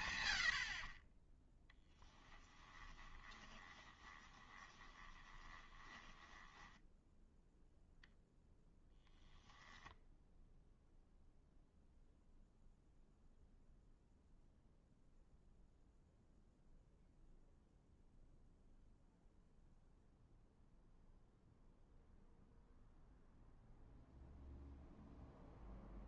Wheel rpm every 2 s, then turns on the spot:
60, 20, 20, 10, 10, 0, 0, 0, 0, 0, 0, 0, 0.
2-8